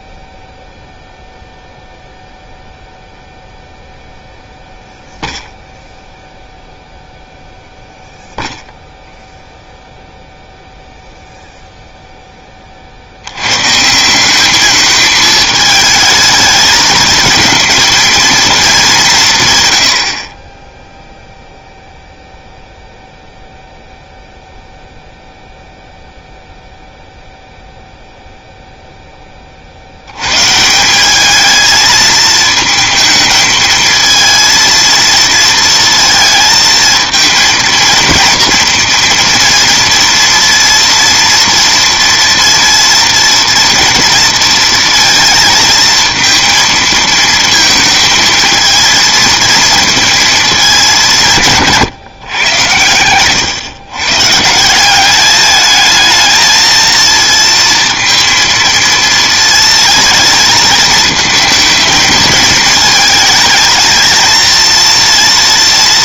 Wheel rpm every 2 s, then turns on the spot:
0, 0, 0, 0, 0, 0, 40, 220, 220, 200, 10, 0, 0, 0, 0, 150, 220, 230, 220, 230, 230, 230, 230, 230, 220, 220, 120, 180, 230, 230, 220, 220, 230.
none